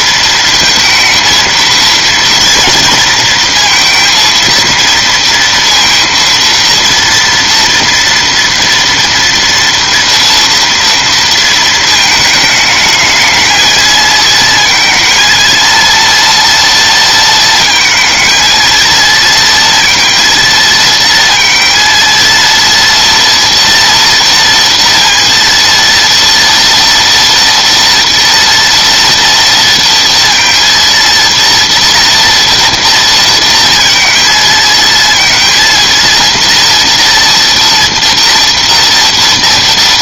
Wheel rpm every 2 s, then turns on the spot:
230, 230, 230, 230, 230, 230, 220, 230, 230, 230, 230, 230, 230, 230, 230, 230, 230, 220, 230, 230.
none